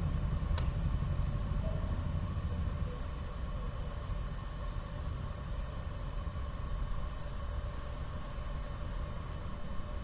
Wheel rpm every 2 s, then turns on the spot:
0, 0, 0, 0, 0.
none